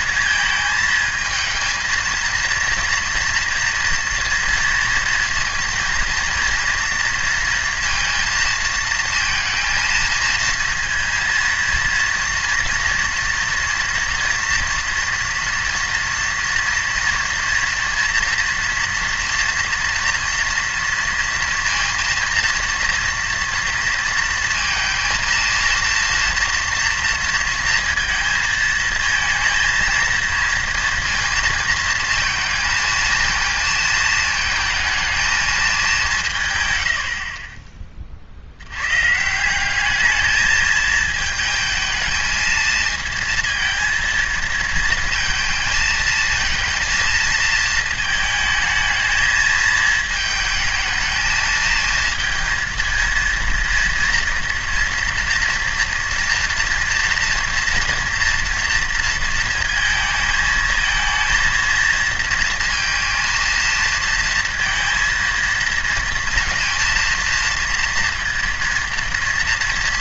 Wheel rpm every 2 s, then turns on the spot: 220, 230, 230, 230, 230, 230, 230, 230, 230, 230, 230, 230, 230, 230, 220, 230, 220, 220, 110, 100, 220, 220, 220, 230, 220, 220, 230, 230, 230, 240, 220, 230, 230, 230, 230.
none